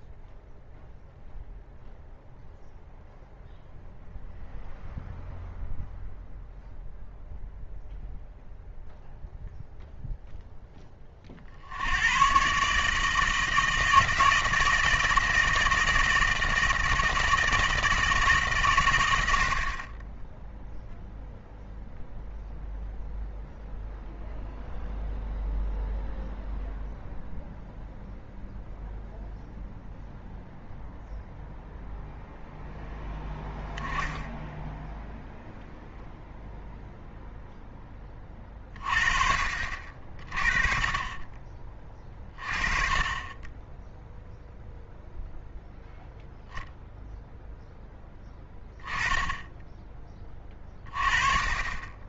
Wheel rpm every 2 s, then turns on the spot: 0, 0, 0, 0, 0, 10, 140, 160, 160, 130, 0, 0, 0, 0, 0, 0, 0, 10, 0, 30, 40, 30, 0, 0, 20, 20.
none